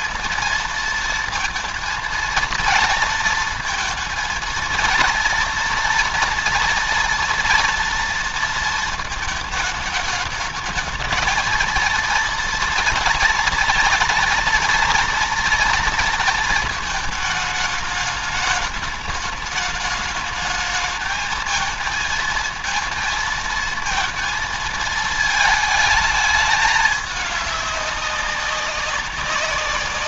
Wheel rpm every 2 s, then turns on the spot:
230, 230, 230, 230, 230, 220, 230, 230, 210, 210, 220, 230, 220, 210, 190.
none